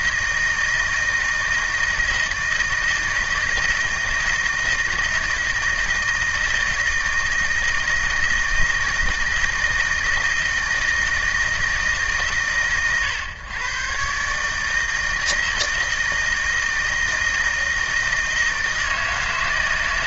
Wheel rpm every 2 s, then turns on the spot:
160, 160, 160, 160, 160, 160, 120, 160, 160, 160.
none